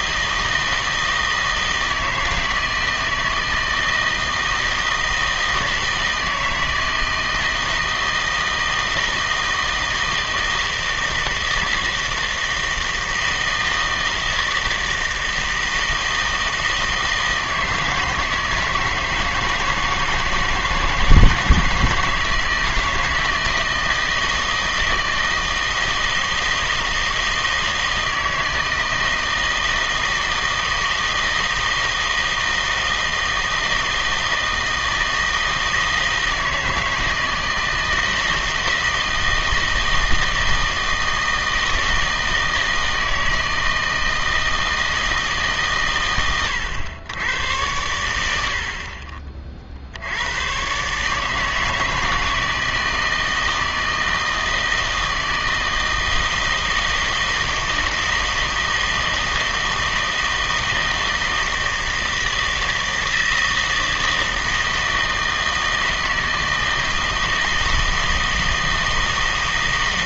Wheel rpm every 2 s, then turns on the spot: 160, 160, 160, 160, 160, 160, 160, 160, 160, 160, 160, 160, 160, 160, 160, 160, 160, 160, 160, 160, 160, 160, 150, 100, 40, 160, 160, 160, 160, 160, 160, 160, 160, 160, 160.
none